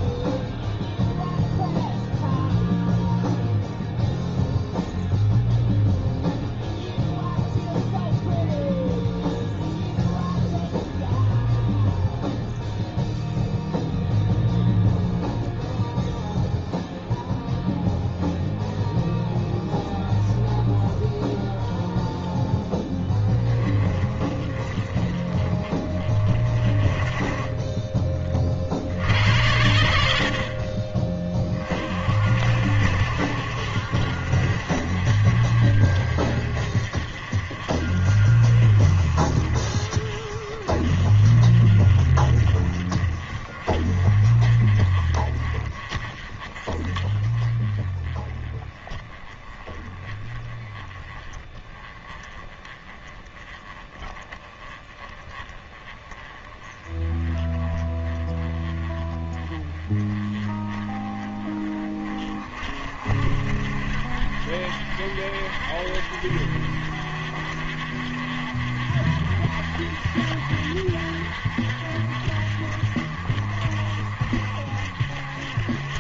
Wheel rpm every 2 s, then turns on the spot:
0, 0, 0, 0, 0, 0, 0, 0, 0, 0, 0, 10, 30, 30, 60, 30, 60, 50, 50, 40, 40, 40, 30, 30, 20, 20, 20, 20, 20, 20, 20, 40, 50, 50, 50, 50, 50, 50.
none